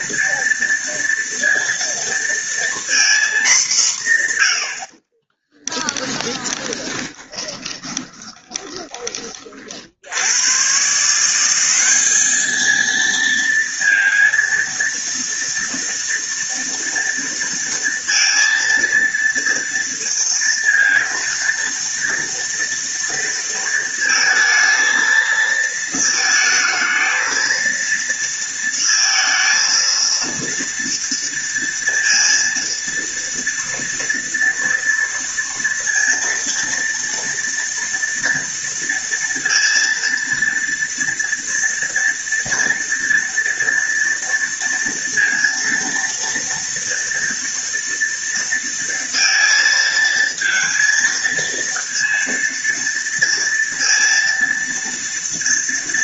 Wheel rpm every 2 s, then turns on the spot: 230, 230, 100, 20, 20, 120, 220, 230, 230, 230, 230, 230, 230, 230, 230, 230, 230, 230, 230, 230, 230, 230, 230, 230, 230, 230, 230, 230.
6-10